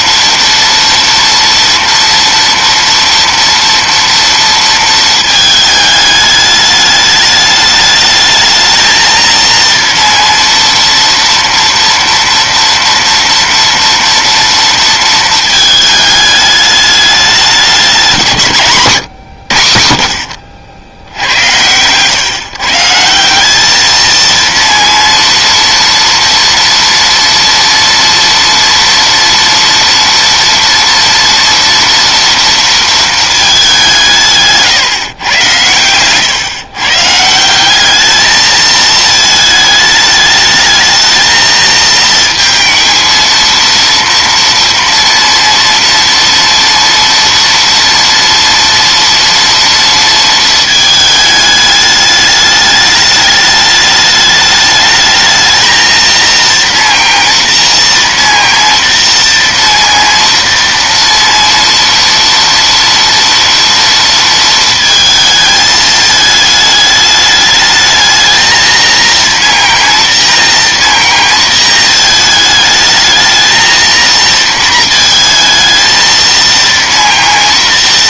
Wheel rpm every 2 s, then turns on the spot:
230, 230, 220, 210, 230, 230, 230, 220, 210, 100, 90, 180, 230, 230, 230, 240, 220, 120, 160, 220, 220, 230, 230, 230, 230, 210, 210, 220, 230, 230, 230, 230, 220, 210, 230, 230, 220, 230, 230.
none